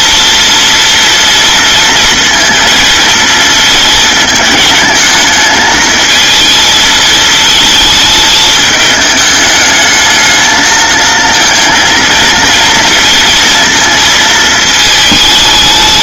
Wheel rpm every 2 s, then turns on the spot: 230, 230, 210, 220, 210, 220, 230, 220.
none